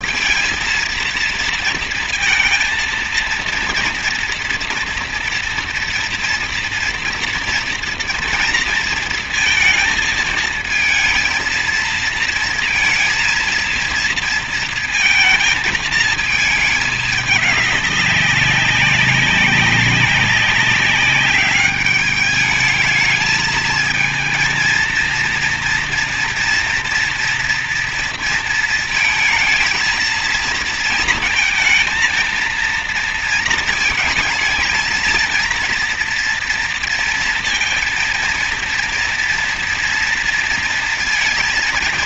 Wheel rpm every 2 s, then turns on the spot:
230, 230, 230, 230, 230, 220, 230, 230, 220, 200, 190, 200, 220, 230, 230, 230, 230, 220, 230, 230, 230.
none